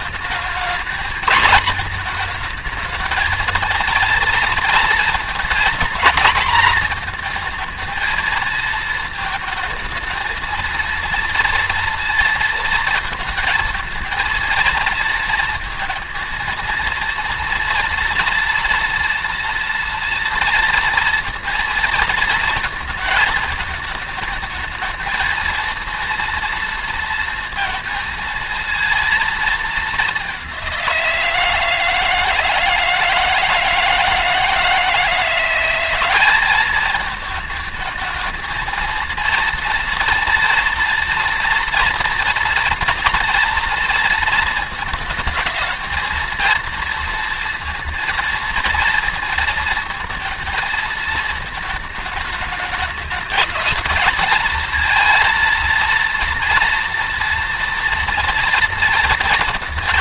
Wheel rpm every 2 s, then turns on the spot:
230, 220, 230, 230, 230, 230, 230, 230, 230, 230, 230, 230, 220, 230, 230, 190, 160, 160, 200, 220, 230, 230, 220, 230, 230, 220, 210, 220, 230, 230.
none